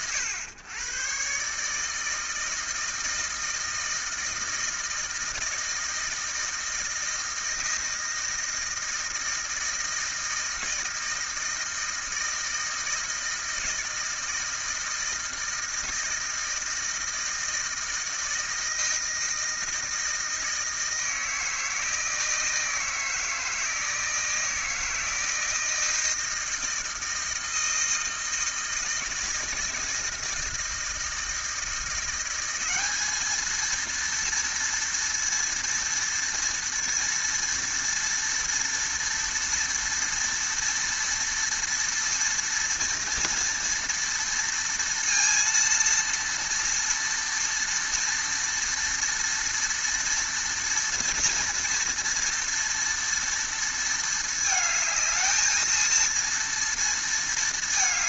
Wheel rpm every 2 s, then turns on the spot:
110, 160, 160, 160, 160, 160, 160, 160, 160, 160, 160, 160, 160, 160, 160, 160, 200, 230, 230, 230, 230, 230, 230, 230, 230, 230, 230, 220, 230.
none